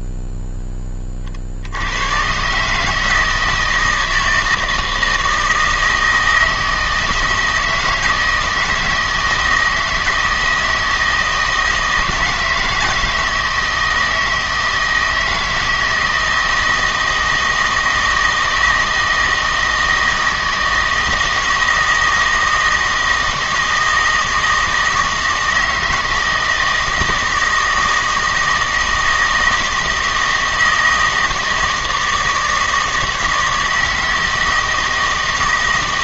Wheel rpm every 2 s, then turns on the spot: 20, 150, 160, 160, 160, 160, 160, 160, 160, 160, 160, 160, 160, 160, 160, 160, 160, 160.
none